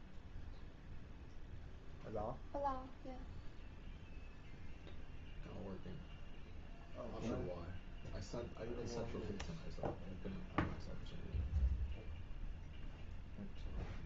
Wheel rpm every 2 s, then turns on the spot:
0, 0, 0, 0, 0, 0, 0.
none